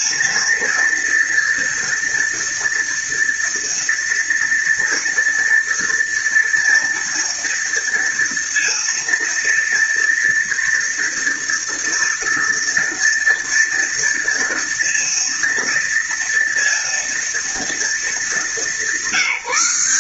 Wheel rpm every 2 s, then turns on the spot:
230, 230, 230, 230, 230, 230, 230, 230, 230, 190.
none